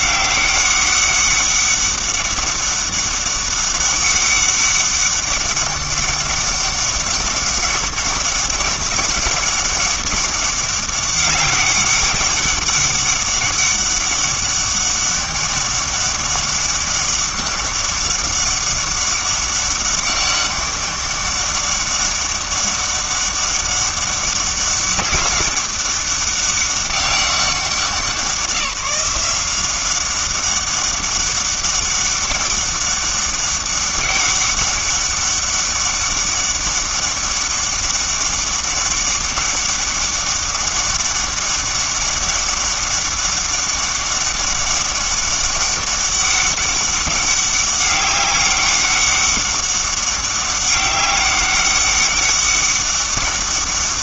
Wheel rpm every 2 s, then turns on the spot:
200, 200, 200, 200, 200, 200, 200, 200, 200, 200, 200, 200, 200, 200, 180, 200, 200, 200, 200, 200, 200, 200, 200, 200, 200, 200, 200.
none